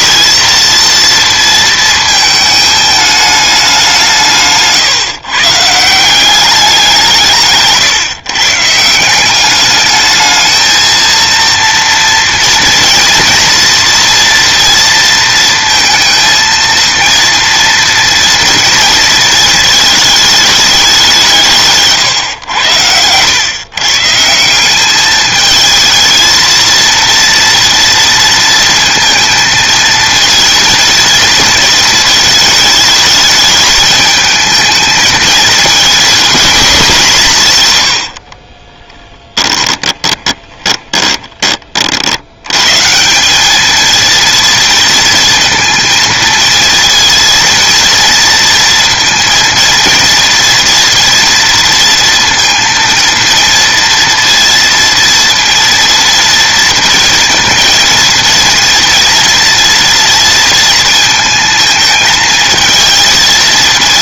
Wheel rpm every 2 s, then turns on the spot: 230, 210, 150, 180, 160, 230, 230, 230, 230, 230, 190, 100, 200, 230, 230, 230, 220, 220, 200, 20, 20, 160, 230, 230, 230, 230, 230, 230, 230, 230, 230, 220.
38-42